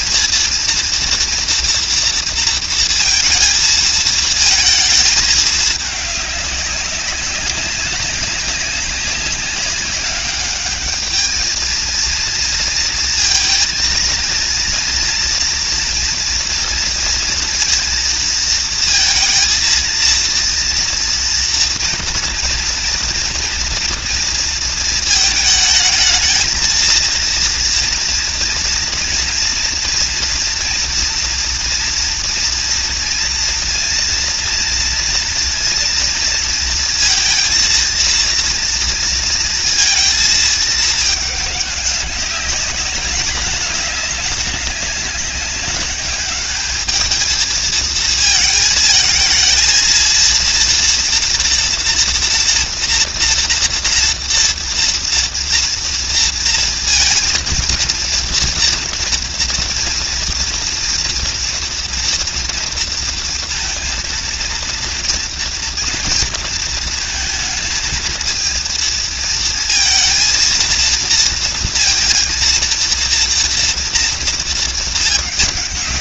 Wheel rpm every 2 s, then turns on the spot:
230, 230, 220, 200, 200, 210, 230, 230, 230, 230, 230, 230, 230, 220, 240, 230, 230, 230, 230, 230, 220, 200, 200, 200, 220, 230, 240, 230, 230, 230, 230, 230, 230, 230, 230, 230, 230, 220.
none